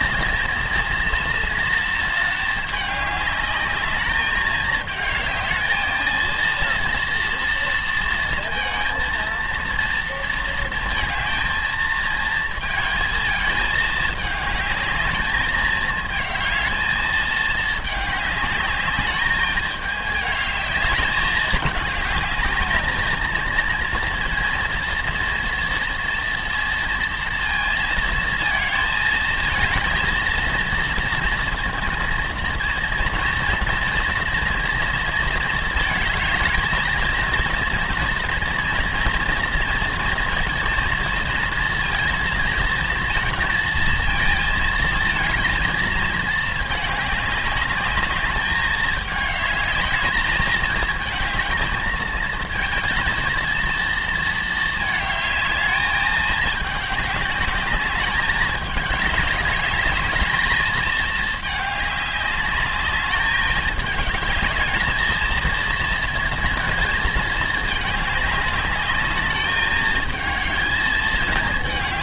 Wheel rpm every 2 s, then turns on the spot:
230, 210, 220, 230, 230, 220, 220, 210, 220, 210, 210, 220, 240, 230, 220, 230, 230, 230, 230, 230, 230, 230, 230, 200, 210, 220, 230, 220, 200, 200, 210, 210, 220, 220, 210, 220.
none